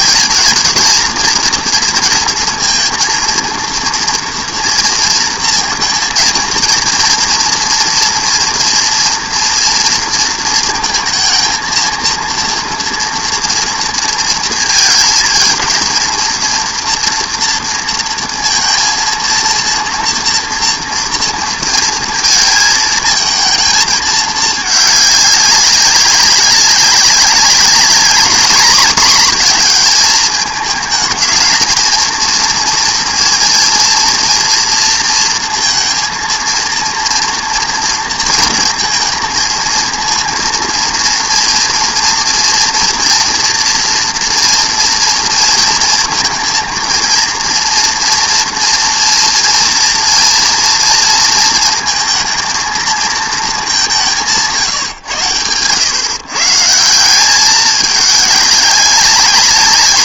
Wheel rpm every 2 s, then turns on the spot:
220, 230, 230, 230, 240, 230, 230, 230, 230, 230, 230, 230, 210, 190, 220, 210, 230, 230, 230, 230, 230, 230, 230, 230, 230, 230, 220, 150, 160, 200.
none